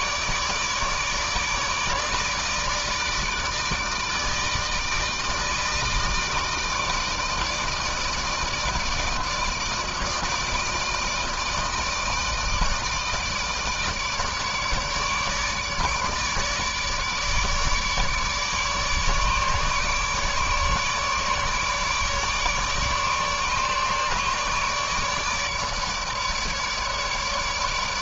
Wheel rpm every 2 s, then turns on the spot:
150, 150, 160, 160, 150, 160, 160, 150, 150, 150, 150, 150, 150, 150.
none